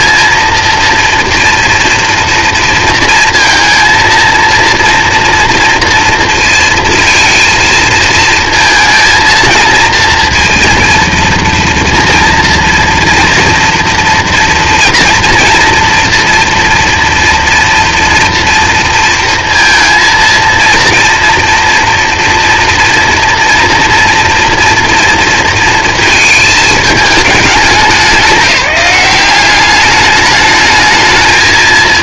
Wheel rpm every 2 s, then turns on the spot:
230, 240, 230, 230, 230, 230, 230, 230, 240, 230, 230, 230, 230, 220, 180, 210.
none